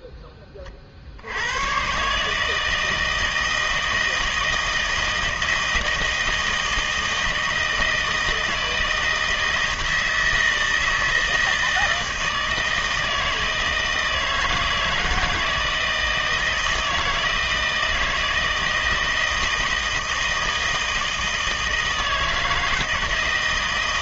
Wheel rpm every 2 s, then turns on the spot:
30, 160, 160, 160, 160, 160, 160, 160, 160, 160, 160, 160.
none